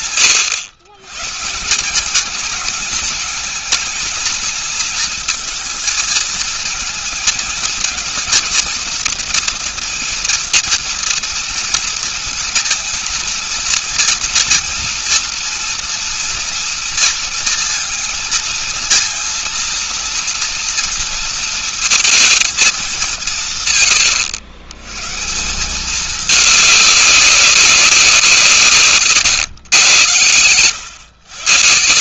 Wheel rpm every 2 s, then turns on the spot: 130, 220, 230, 230, 230, 230, 220, 230, 230, 220, 230, 200, 130, 200, 140, 100.
none